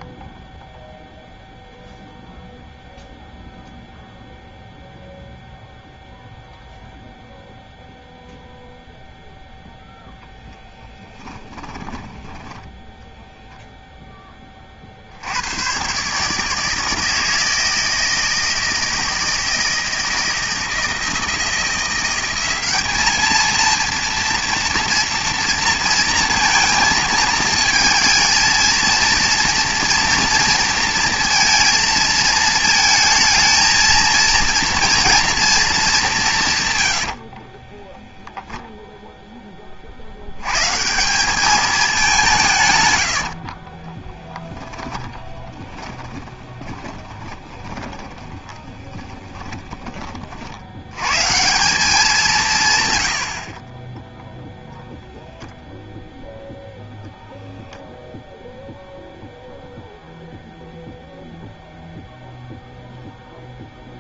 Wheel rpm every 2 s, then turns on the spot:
0, 0, 0, 0, 0, 10, 10, 40, 160, 160, 160, 200, 230, 230, 230, 230, 220, 230, 130, 0, 150, 120, 20, 10, 20, 120, 110, 0, 0, 0, 0, 0.
10-12 36-38 44-50